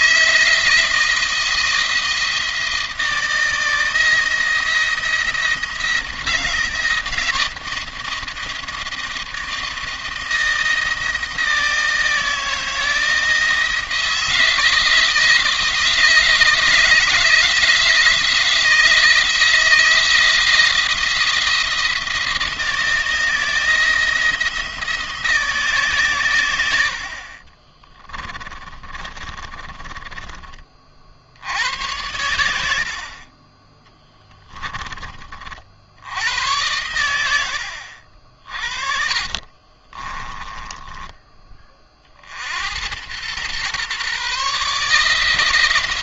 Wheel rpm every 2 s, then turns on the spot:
160, 160, 170, 170, 170, 170, 160, 160, 160, 160, 170, 170, 160, 70, 30, 40, 70, 20, 90, 50, 10, 90, 150.
28-30 38-42